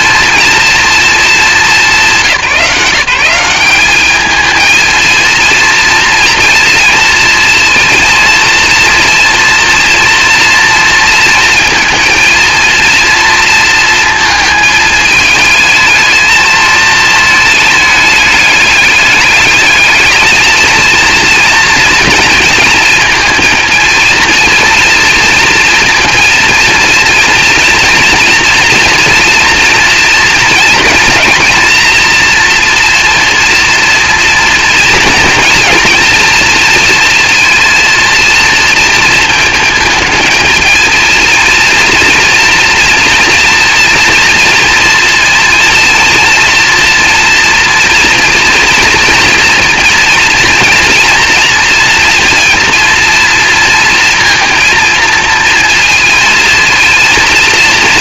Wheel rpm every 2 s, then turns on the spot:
230, 180, 230, 230, 230, 230, 230, 220, 220, 210, 230, 230, 230, 230, 230, 220, 230, 230, 230, 230, 230, 230, 230, 230, 230, 230, 230, 220, 230.
none